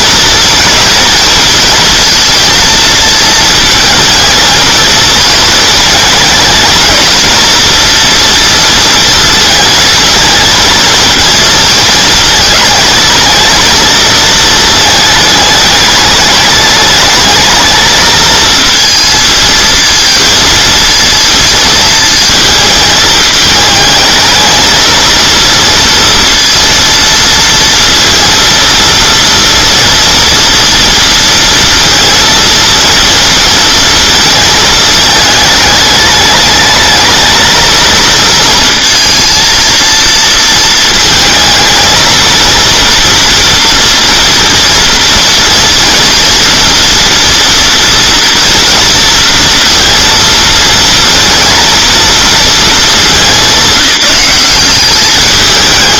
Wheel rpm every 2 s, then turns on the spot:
230, 220, 220, 220, 230, 220, 230, 220, 210, 220, 220, 220, 230, 230, 230, 230, 230, 220, 210, 230, 220, 230, 240, 230, 230, 230, 220, 190.
none